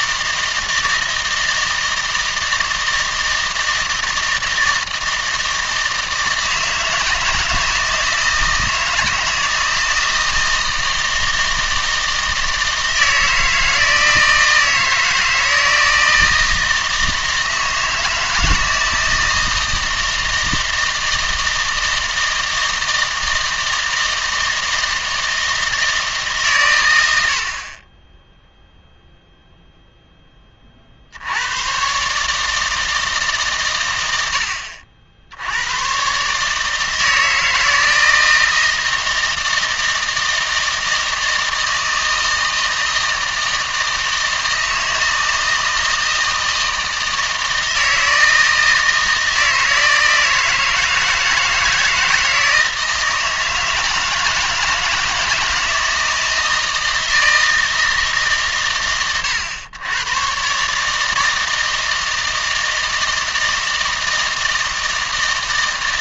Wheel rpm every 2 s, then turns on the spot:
160, 160, 160, 160, 160, 160, 160, 160, 160, 160, 160, 160, 160, 120, 0, 30, 160, 70, 150, 160, 160, 160, 160, 160, 160, 160, 160, 160, 160, 110, 130, 160, 160.
none